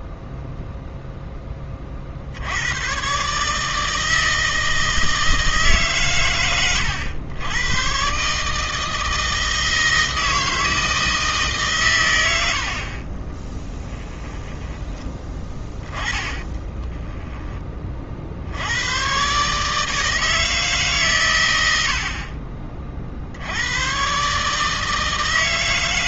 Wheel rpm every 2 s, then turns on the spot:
0, 90, 160, 100, 150, 160, 60, 10, 10, 80, 160, 40, 150.
12-18